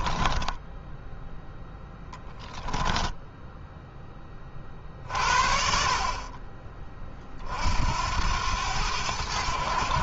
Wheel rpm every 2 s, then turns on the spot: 0, 10, 40, 30, 90.
2-4